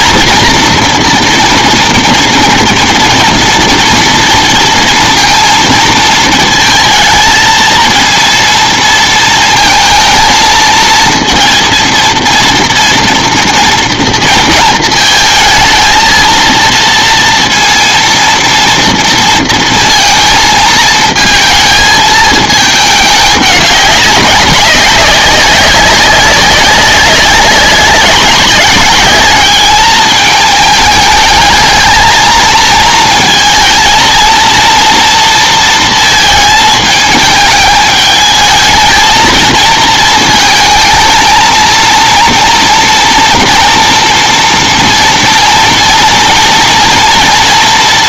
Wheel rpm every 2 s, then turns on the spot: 230, 230, 230, 220, 230, 220, 230, 230, 230, 230, 230, 210, 190, 190, 200, 210, 230, 230, 220, 220, 220, 230, 230, 230.
none